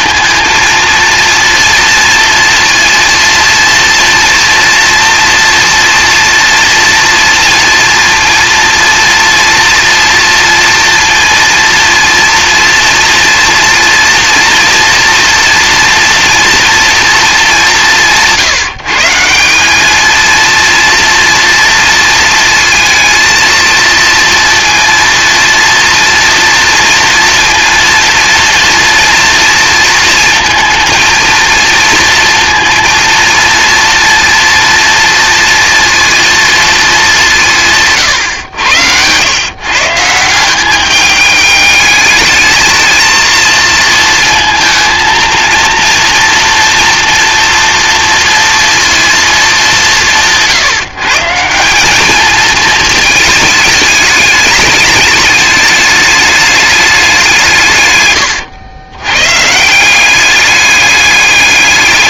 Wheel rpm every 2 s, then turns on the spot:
230, 230, 230, 230, 230, 230, 230, 230, 230, 160, 230, 230, 230, 230, 230, 230, 230, 230, 220, 90, 200, 220, 220, 230, 230, 150, 220, 210, 210, 100, 200.
none